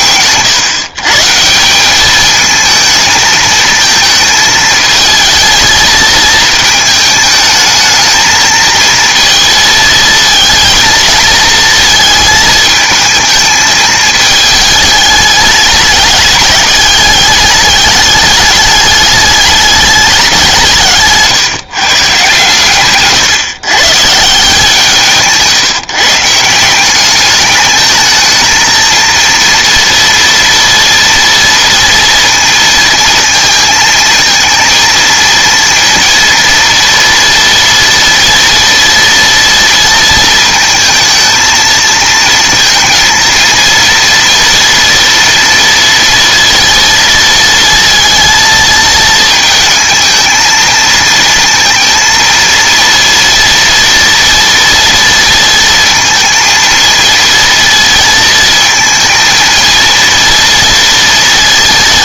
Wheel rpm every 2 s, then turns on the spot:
130, 220, 220, 220, 220, 220, 220, 220, 210, 210, 170, 140, 170, 180, 230, 230, 230, 220, 230, 230, 230, 230, 240, 230, 220, 220, 230, 240, 230, 230, 230.
none